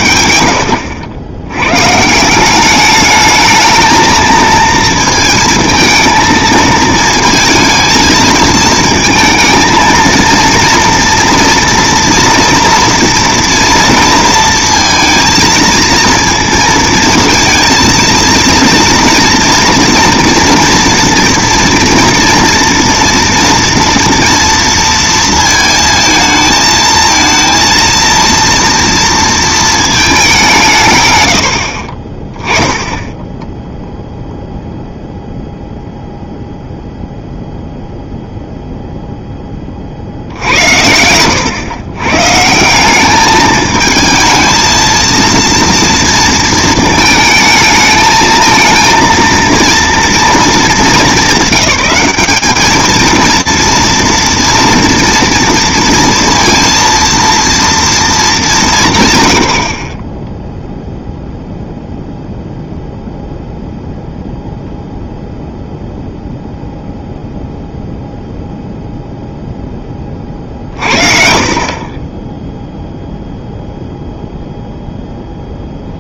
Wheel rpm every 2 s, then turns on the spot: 70, 200, 220, 230, 230, 230, 230, 230, 220, 230, 240, 230, 230, 220, 230, 150, 10, 0, 0, 0, 70, 150, 220, 220, 220, 220, 210, 230, 230, 180, 0, 0, 0, 0, 0, 40, 0, 0.
none